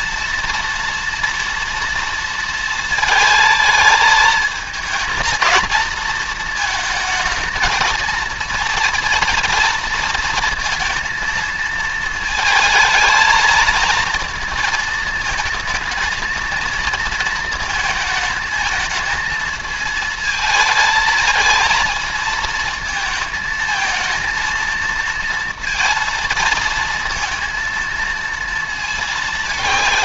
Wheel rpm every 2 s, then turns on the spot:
230, 230, 220, 220, 230, 230, 220, 220, 230, 220, 220, 230, 230, 230, 230.
none